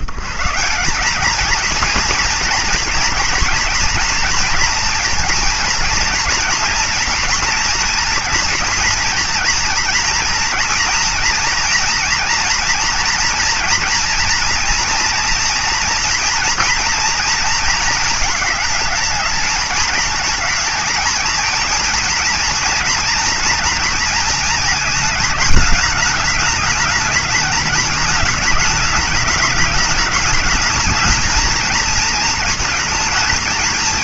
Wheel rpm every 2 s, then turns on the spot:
120, 230, 230, 230, 230, 230, 230, 230, 230, 220, 220, 230, 220, 210, 210, 210, 230.
none